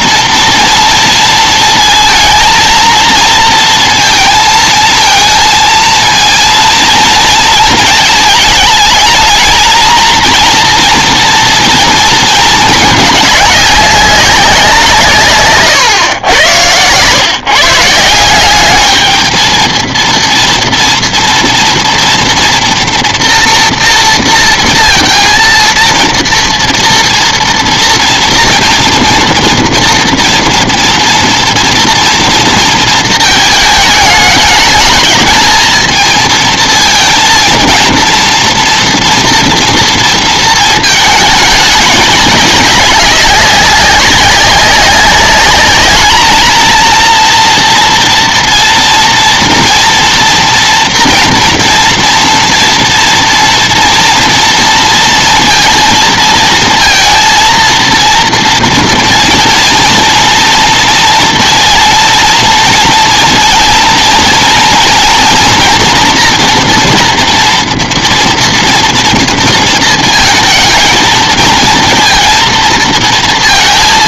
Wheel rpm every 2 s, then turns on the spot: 230, 230, 230, 230, 220, 230, 230, 200, 110, 170, 230, 230, 230, 230, 230, 230, 240, 210, 230, 230, 230, 210, 190, 220, 230, 230, 230, 230, 230, 230, 230, 230, 230, 240, 230, 220, 230.
none